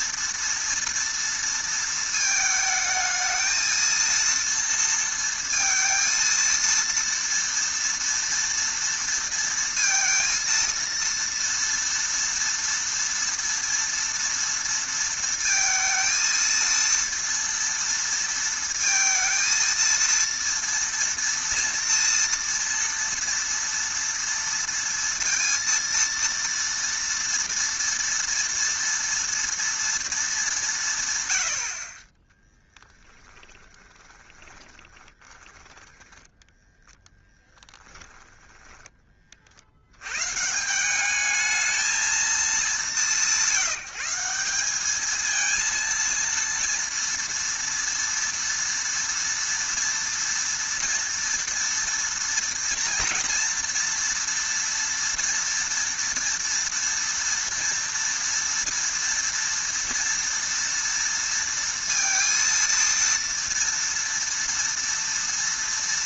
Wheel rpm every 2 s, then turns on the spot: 230, 220, 230, 230, 230, 230, 230, 230, 230, 230, 230, 230, 230, 230, 230, 160, 10, 20, 0, 20, 180, 190, 210, 230, 230, 230, 230, 230, 230, 230, 230, 230, 230.
32-36 38-40